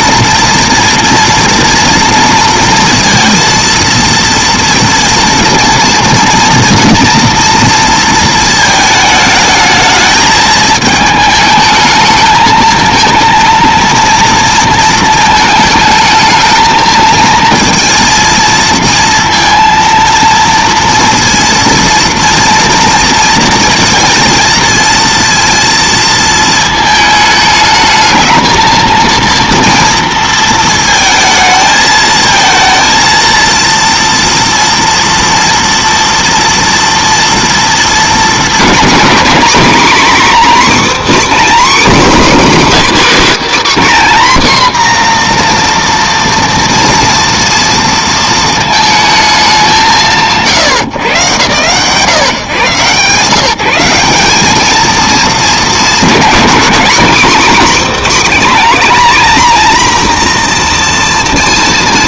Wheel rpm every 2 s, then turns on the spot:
230, 230, 230, 240, 220, 220, 220, 230, 220, 230, 230, 230, 230, 220, 230, 220, 220, 230, 230, 210, 280, 290, 250, 230, 220, 110, 140, 220, 230, 260, 240.
none